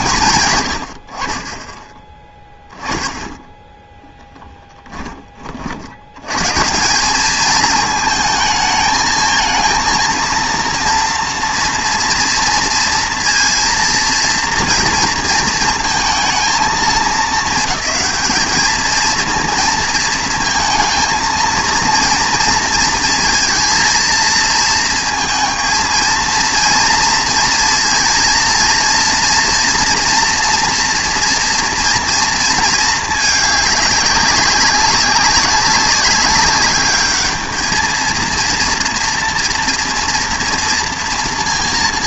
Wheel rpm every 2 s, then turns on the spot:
100, 10, 20, 160, 220, 230, 230, 230, 220, 220, 230, 230, 220, 230, 230, 230, 230, 190, 200, 230, 230.
none